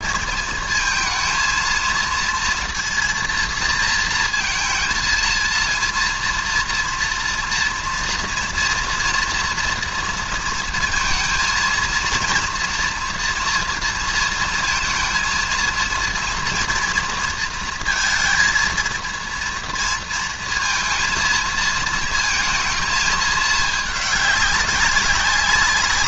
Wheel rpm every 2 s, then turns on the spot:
220, 230, 230, 230, 230, 230, 230, 230, 230, 220, 230, 220, 200.
none